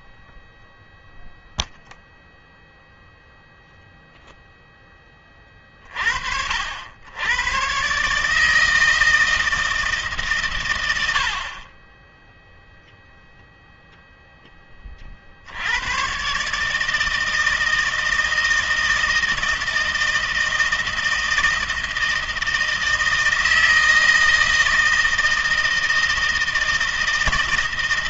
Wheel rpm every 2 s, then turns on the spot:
0, 0, 0, 70, 150, 130, 0, 10, 130, 160, 160, 160, 160, 160.
none